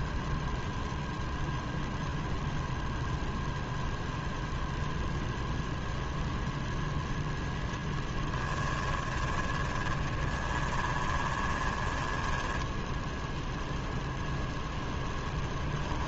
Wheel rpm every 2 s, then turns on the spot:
0, 0, 0, 0, 20, 20, 10, 0.
8-14